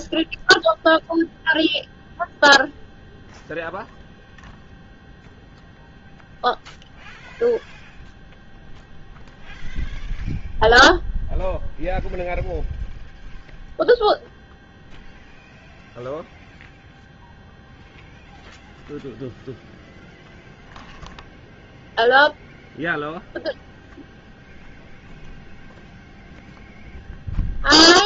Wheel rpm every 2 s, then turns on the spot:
0, 0, 0, 0, 0, 0, 0, 0, 0, 0, 0, 0, 0, 0.
none